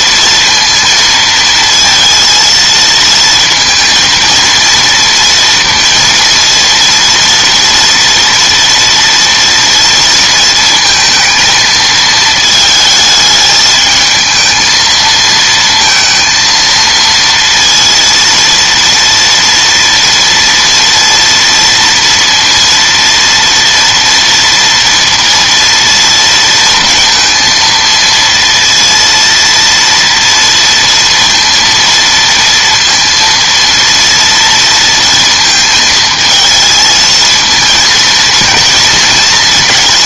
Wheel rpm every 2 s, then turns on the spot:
230, 230, 230, 230, 230, 230, 220, 220, 230, 230, 230, 230, 230, 230, 230, 230, 230, 230, 220, 230.
none